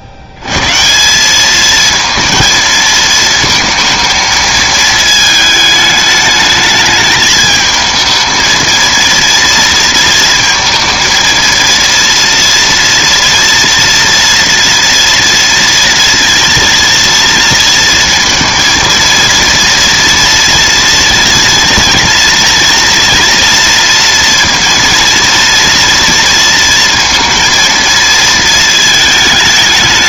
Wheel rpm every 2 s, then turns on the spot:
80, 230, 220, 210, 230, 230, 230, 230, 230, 230, 230, 230, 230, 230, 220.
none